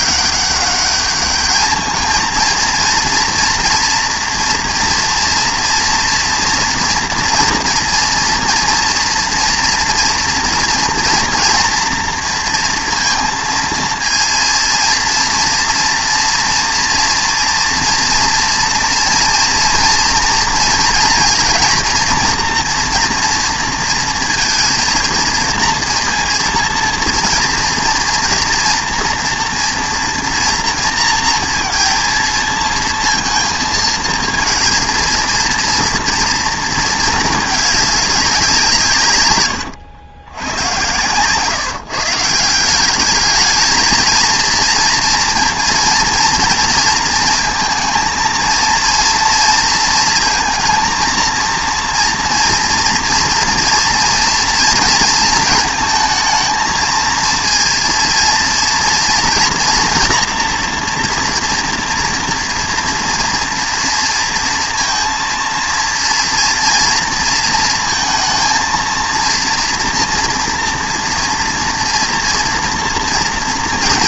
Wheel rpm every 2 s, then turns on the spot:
200, 230, 230, 240, 230, 240, 230, 230, 230, 240, 230, 240, 230, 240, 230, 230, 230, 230, 230, 150, 130, 190, 230, 230, 230, 230, 230, 230, 230, 240, 230, 240, 230, 230, 230, 230, 230.
none